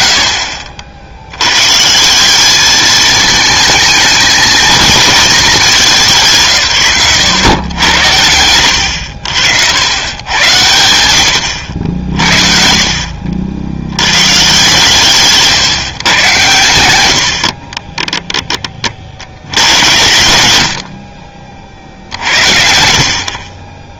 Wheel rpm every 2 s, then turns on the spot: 50, 210, 230, 140, 80, 100, 50, 140, 100, 20, 80, 70.
none